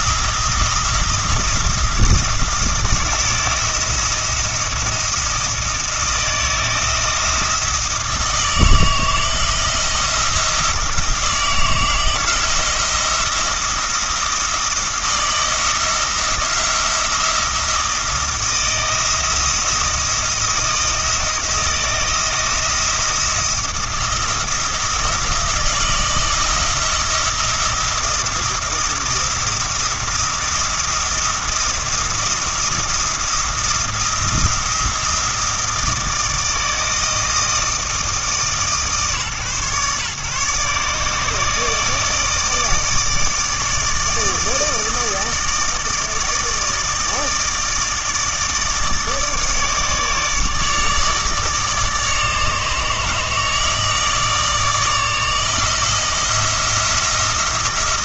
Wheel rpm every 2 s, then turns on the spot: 170, 160, 170, 170, 160, 170, 170, 170, 170, 170, 170, 160, 170, 160, 170, 170, 170, 170, 160, 150, 150, 160, 160, 160, 160, 150, 150, 160, 170.
none